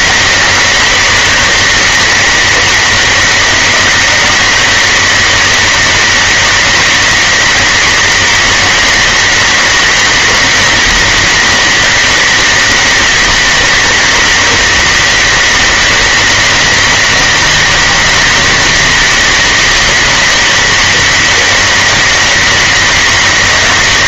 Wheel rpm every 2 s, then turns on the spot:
200, 200, 200, 200, 200, 200, 200, 200, 200, 200, 200, 200.
none